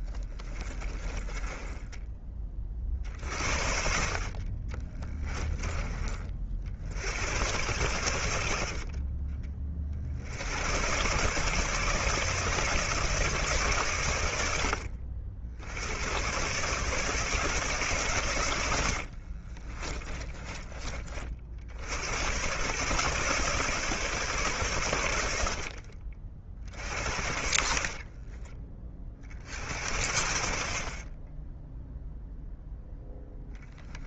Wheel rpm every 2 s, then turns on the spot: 20, 30, 30, 50, 50, 90, 140, 80, 130, 80, 30, 120, 110, 50, 30, 60, 0.
0-2 4-6 18-20